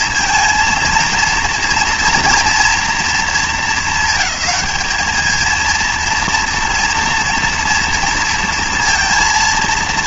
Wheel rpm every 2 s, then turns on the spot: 230, 220, 210, 230, 230.
none